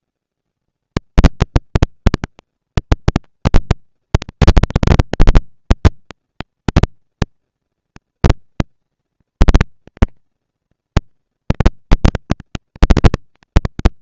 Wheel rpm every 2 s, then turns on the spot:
140, 220, 220, 230, 230, 230, 230.
none